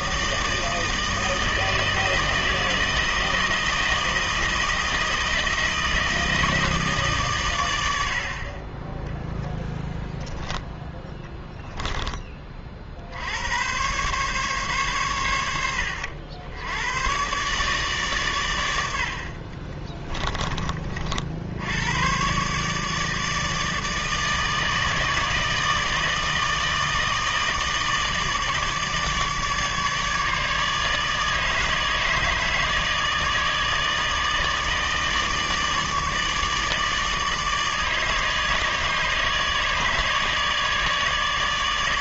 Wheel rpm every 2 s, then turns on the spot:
160, 160, 160, 160, 30, 10, 40, 130, 100, 100, 30, 140, 160, 160, 160, 150, 150, 160, 150, 150, 150.
none